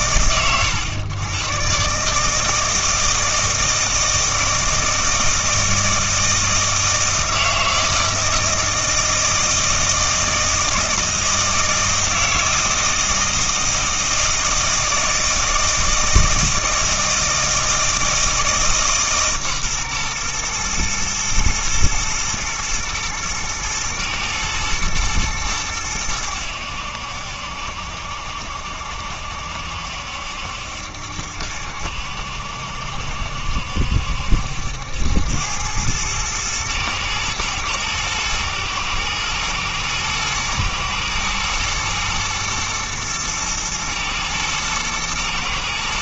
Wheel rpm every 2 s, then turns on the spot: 100, 160, 160, 160, 160, 160, 160, 160, 160, 150, 110, 120, 120, 80, 70, 70, 70, 80, 110, 120, 110, 110, 110.
none